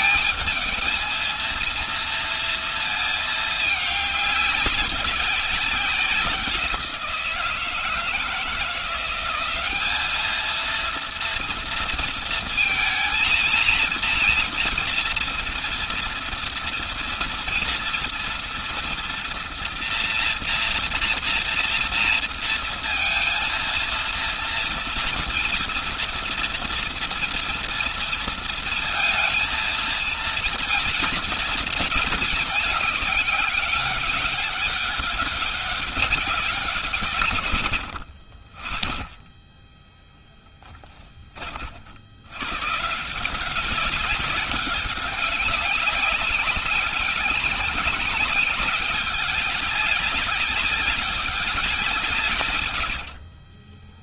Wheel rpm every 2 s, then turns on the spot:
220, 230, 200, 180, 170, 220, 230, 230, 230, 230, 230, 230, 230, 230, 230, 230, 220, 200, 180, 30, 10, 110, 190, 200, 200, 200, 130.
52-54